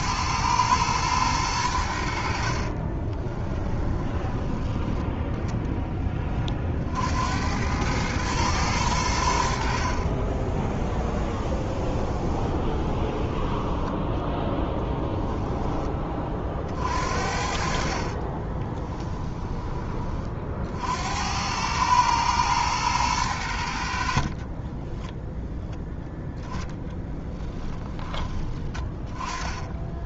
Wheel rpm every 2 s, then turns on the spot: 110, 40, 10, 50, 100, 20, 20, 10, 40, 20, 60, 110, 20, 10, 20.
2-4 10-14 18-20 24-28